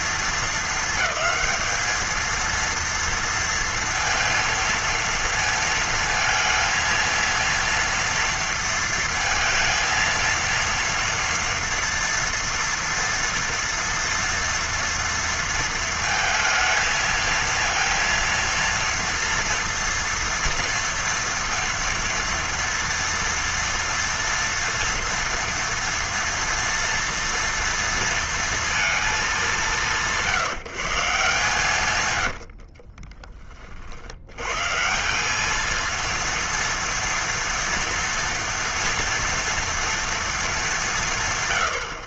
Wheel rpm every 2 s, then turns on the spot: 220, 230, 230, 230, 230, 230, 230, 230, 230, 230, 230, 230, 240, 230, 230, 160, 50, 140, 230, 230, 190.
32-34